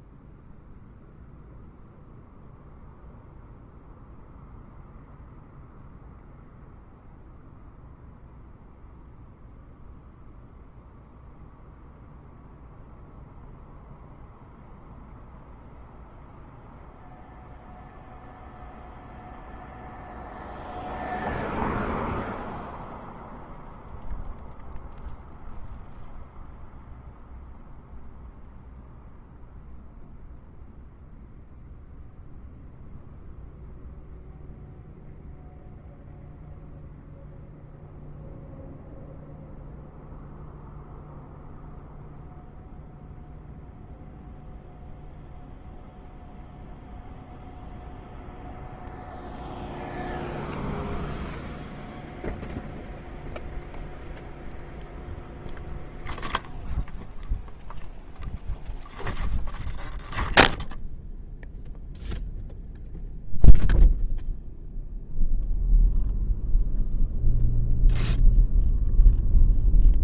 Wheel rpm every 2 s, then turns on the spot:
0, 0, 0, 0, 0, 0, 0, 0, 0, 0, 0, 0, 0, 0, 0, 0, 0, 0, 0, 0, 0, 0, 0, 0, 0, 0, 0, 0, 0, 0, 0, 0, 0, 0, 0.
none